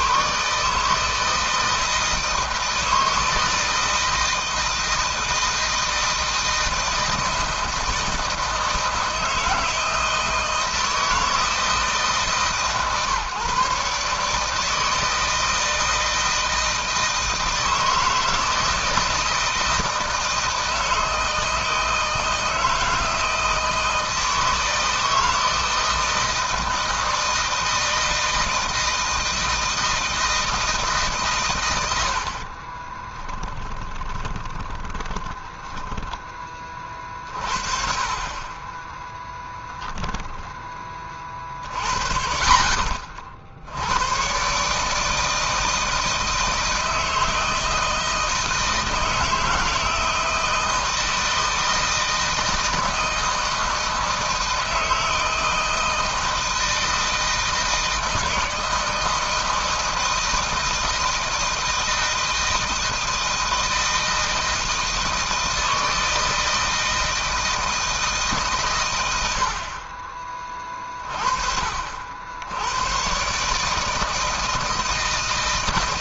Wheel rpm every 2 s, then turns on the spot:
160, 160, 160, 160, 160, 160, 140, 160, 160, 160, 160, 160, 160, 160, 160, 150, 30, 20, 30, 20, 30, 40, 150, 160, 160, 160, 160, 160, 160, 160, 160, 160, 160, 160, 120, 30, 110, 160.
32-36 38-40